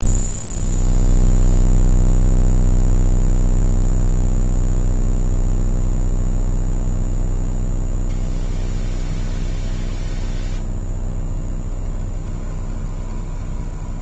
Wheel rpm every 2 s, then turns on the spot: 0, 0, 0, 0, 0, 0, 10.
12-14